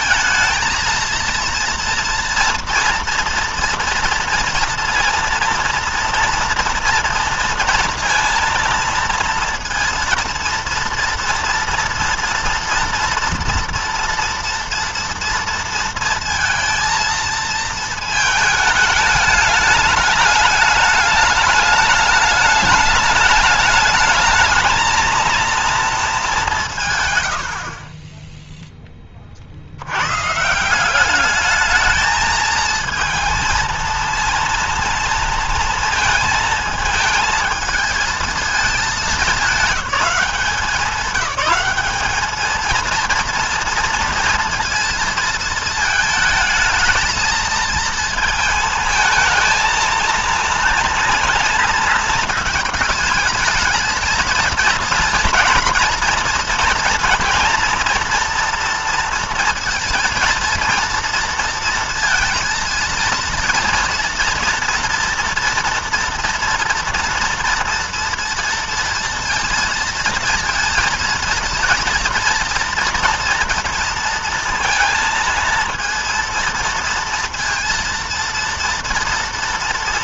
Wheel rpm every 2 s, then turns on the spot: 220, 230, 230, 230, 230, 230, 230, 230, 230, 210, 210, 210, 220, 180, 10, 160, 220, 230, 220, 220, 200, 220, 230, 220, 220, 230, 220, 230, 230, 230, 230, 230, 230, 230, 230, 230, 230, 230, 230, 230.
none